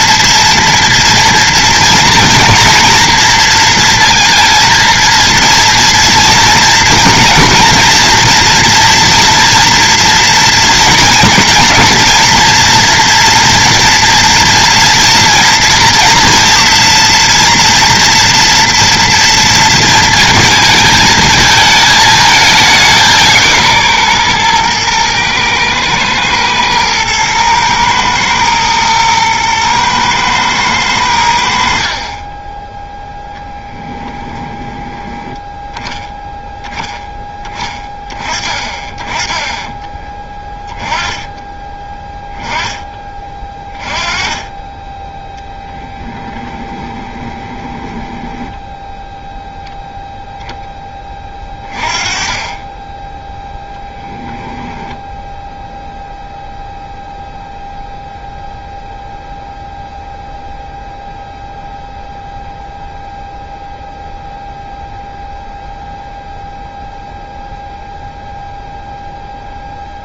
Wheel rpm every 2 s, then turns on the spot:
230, 240, 230, 230, 240, 230, 230, 230, 230, 230, 220, 200, 120, 110, 120, 100, 0, 10, 0, 20, 10, 20, 20, 20, 10, 10, 20, 0, 0, 0, 0, 0, 0, 0, 0.
34-36 46-50